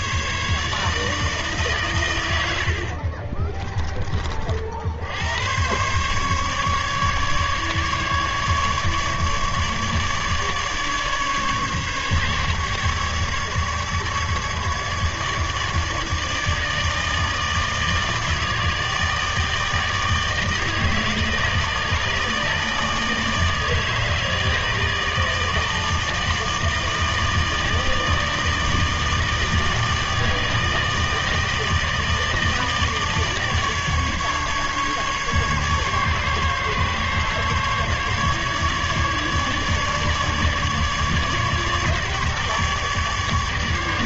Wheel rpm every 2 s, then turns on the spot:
150, 80, 40, 140, 150, 150, 150, 150, 160, 160, 160, 160, 160, 160, 160, 160, 160, 150, 140, 150, 150, 150.
none